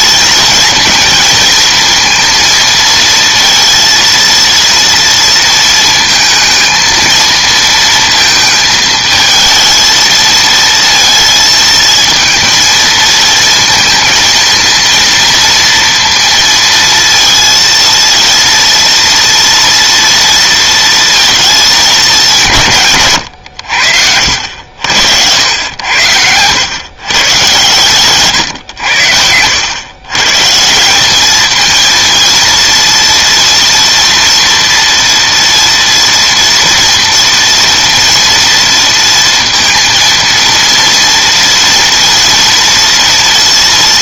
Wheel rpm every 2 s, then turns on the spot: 230, 230, 230, 230, 220, 230, 230, 230, 230, 230, 230, 150, 80, 110, 100, 170, 230, 230, 230, 230, 230, 230.
none